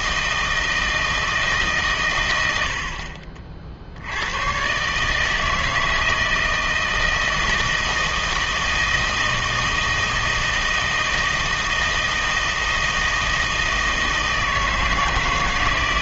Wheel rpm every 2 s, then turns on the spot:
160, 80, 130, 160, 160, 160, 160, 160.
none